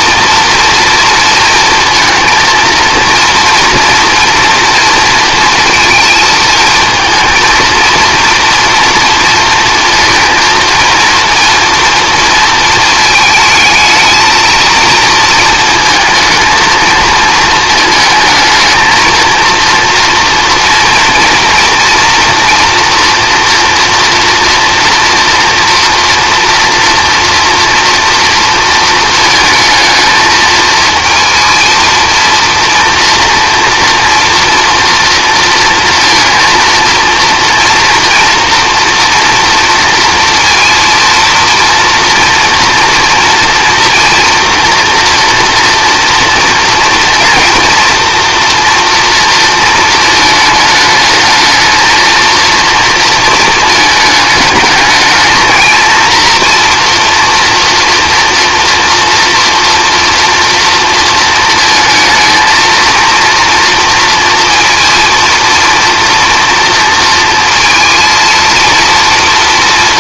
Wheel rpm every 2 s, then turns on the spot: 230, 230, 230, 230, 230, 220, 230, 230, 230, 220, 230, 230, 230, 230, 230, 220, 230, 230, 230, 230, 230, 230, 230, 230, 230, 210, 230, 210, 230, 230, 230, 230, 230, 230, 230.
none